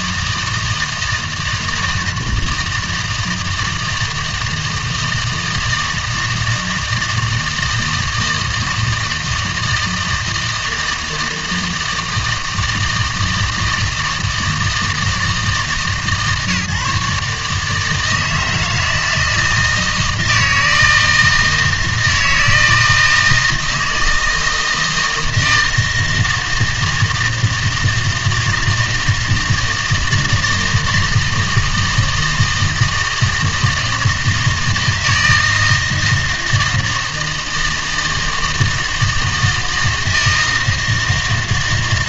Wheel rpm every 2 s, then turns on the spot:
160, 160, 160, 160, 160, 160, 160, 160, 140, 160, 160, 160, 160, 160, 160, 160, 160, 160, 160, 160, 160.
none